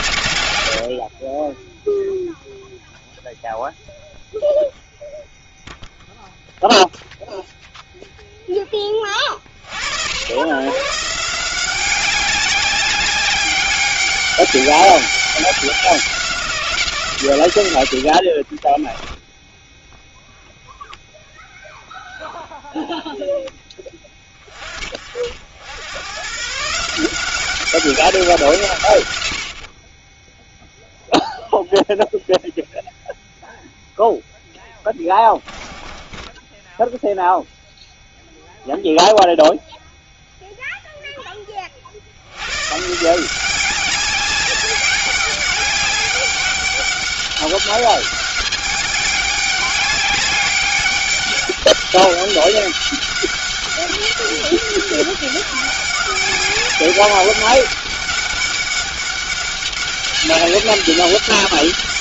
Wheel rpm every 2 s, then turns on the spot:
60, 0, 0, 0, 20, 140, 200, 200, 160, 10, 0, 0, 50, 160, 120, 0, 0, 10, 10, 0, 0, 150, 200, 200, 200, 200, 190, 200, 200, 200, 200.
18-20 34-38